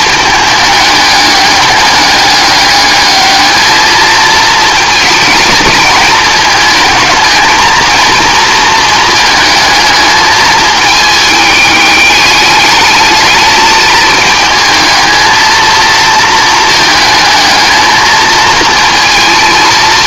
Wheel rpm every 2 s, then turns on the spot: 210, 210, 220, 220, 220, 220, 210, 220, 220, 230.
none